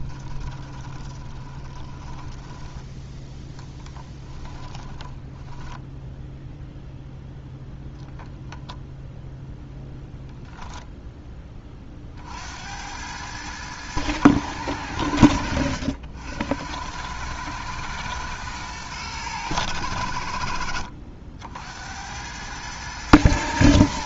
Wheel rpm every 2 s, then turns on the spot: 20, 10, 10, 0, 0, 0, 80, 100, 90, 110, 70, 110.
0-2 4-6